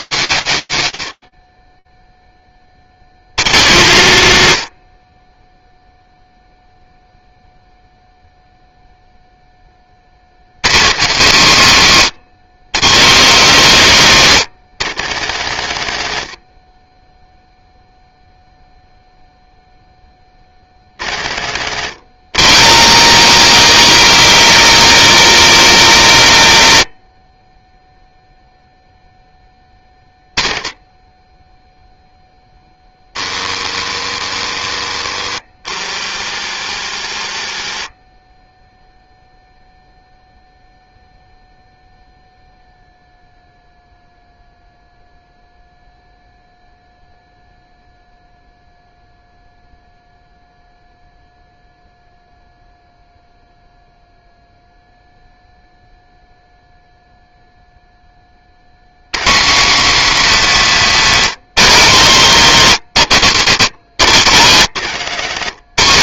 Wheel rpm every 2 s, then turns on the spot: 150, 20, 130, 0, 0, 120, 140, 200, 70, 0, 120, 190, 230, 80, 20, 10, 20, 20, 10, 0, 0, 0, 0, 0, 0, 0, 0, 0, 0, 160, 170, 80, 150.
64-66